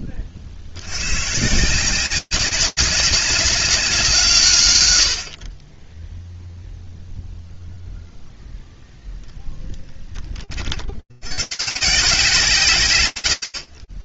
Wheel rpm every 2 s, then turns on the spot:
50, 190, 150, 0, 0, 50, 160.
none